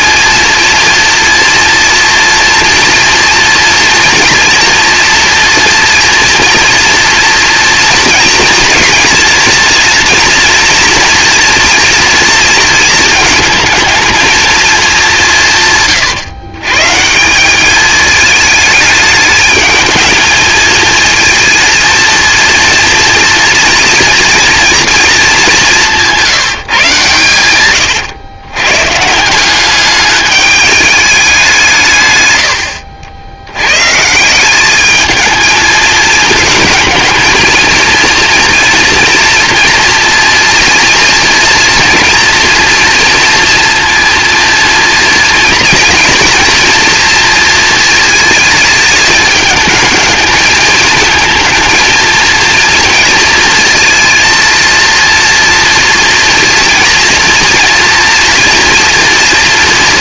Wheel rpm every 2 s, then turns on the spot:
230, 230, 240, 230, 230, 230, 230, 210, 150, 210, 220, 230, 230, 140, 140, 210, 70, 200, 220, 230, 230, 230, 230, 240, 210, 220, 230, 230, 230, 230.
none